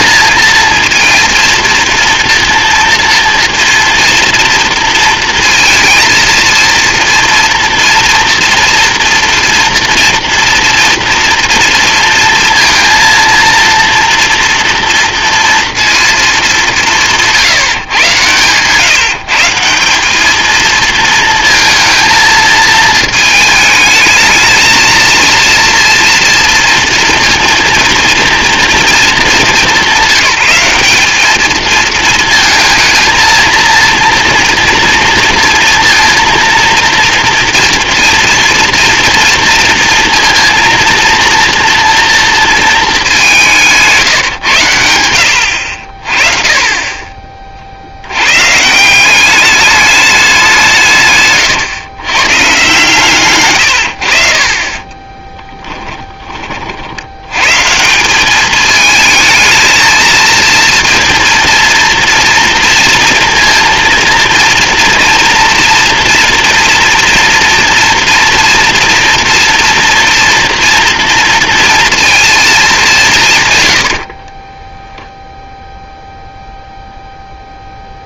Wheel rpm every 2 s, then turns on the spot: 230, 230, 230, 230, 230, 230, 230, 230, 180, 140, 220, 220, 220, 230, 230, 190, 230, 230, 230, 230, 230, 210, 100, 30, 160, 170, 130, 20, 50, 220, 230, 230, 230, 230, 240, 240, 200, 10, 0.
54-56 74-76